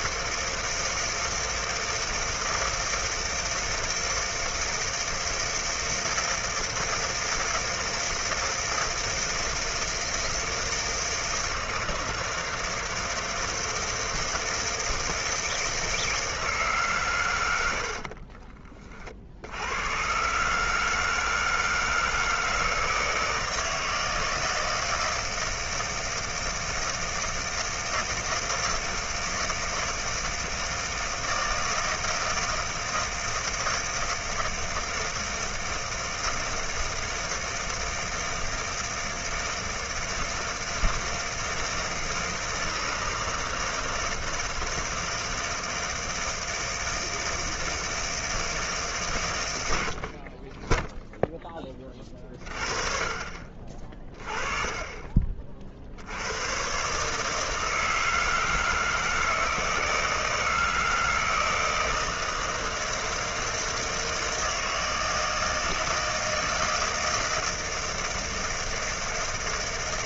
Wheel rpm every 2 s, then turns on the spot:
160, 160, 160, 160, 160, 160, 160, 160, 150, 30, 150, 160, 160, 160, 160, 160, 160, 160, 160, 160, 160, 160, 160, 160, 160, 20, 40, 20, 120, 160, 160, 160, 160, 160, 160.
none